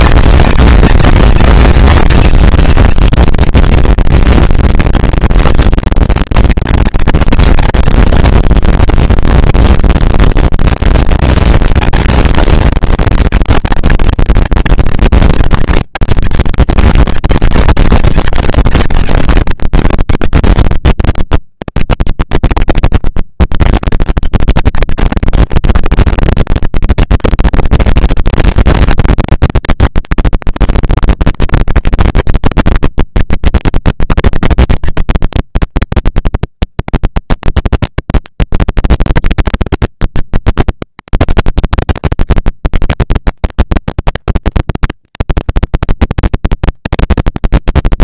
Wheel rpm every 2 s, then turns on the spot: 220, 230, 230, 230, 240, 240, 230, 230, 220, 220, 230, 160, 200, 230, 230, 230, 230, 240, 220, 220, 220, 210, 220, 230.
22-24